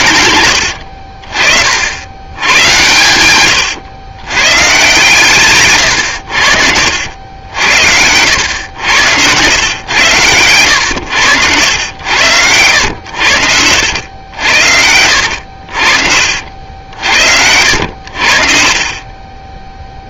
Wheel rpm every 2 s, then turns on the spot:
80, 110, 130, 80, 100, 110, 100, 80, 60, 40.
10-14